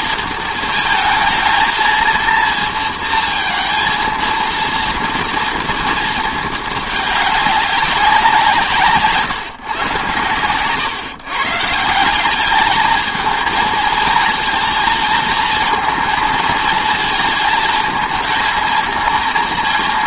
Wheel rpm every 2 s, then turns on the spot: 220, 230, 230, 210, 160, 120, 210, 230, 230, 220.
none